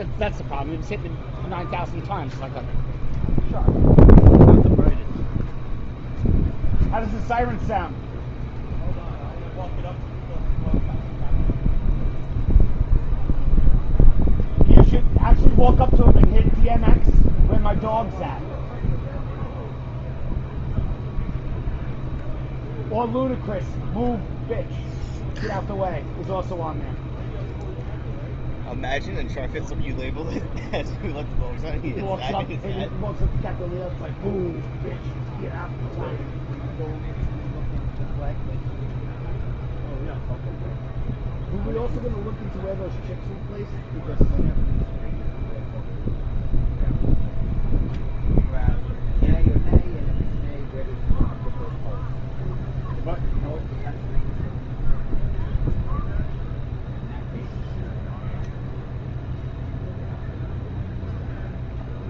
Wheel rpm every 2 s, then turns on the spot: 0, 0, 0, 0, 0, 0, 0, 0, 0, 0, 0, 0, 0, 0, 0, 0, 0, 0, 0, 0, 0, 0, 0, 0, 0, 0, 0, 0, 0, 0, 0.
none